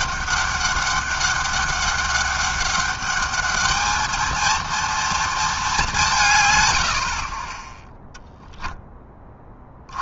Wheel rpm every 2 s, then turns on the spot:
200, 210, 230, 40, 30.
none